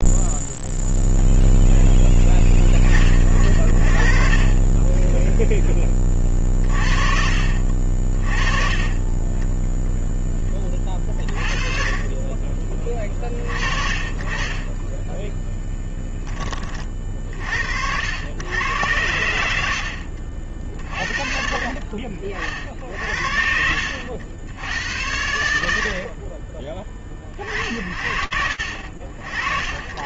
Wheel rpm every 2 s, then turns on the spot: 0, 30, 0, 40, 30, 20, 30, 20, 30, 110, 50, 60, 60, 40, 50.
14-16